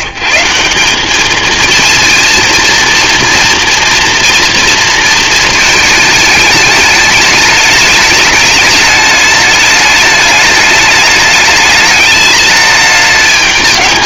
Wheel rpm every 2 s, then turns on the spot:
120, 230, 240, 210, 210, 210, 210.
none